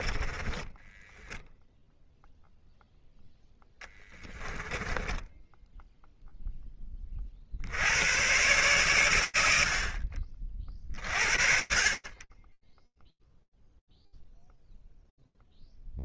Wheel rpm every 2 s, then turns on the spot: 20, 0, 10, 40, 90, 40, 0, 0.
0-2 4-6